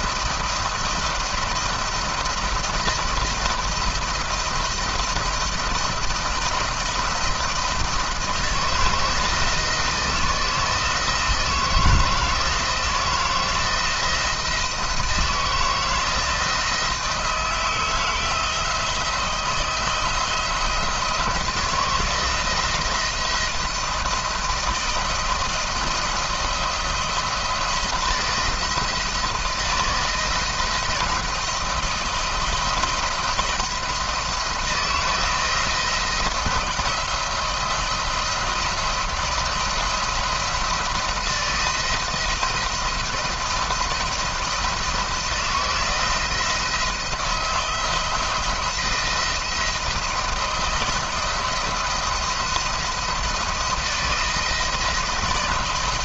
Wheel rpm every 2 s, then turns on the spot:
170, 160, 170, 170, 160, 160, 160, 170, 170, 170, 160, 170, 170, 170, 160, 170, 170, 170, 160, 170, 170, 170, 160, 170, 170, 160, 170, 170.
none